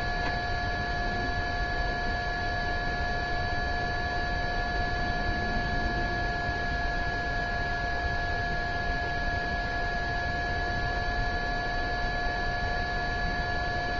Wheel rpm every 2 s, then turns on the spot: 0, 0, 0, 0, 0, 0, 0.
none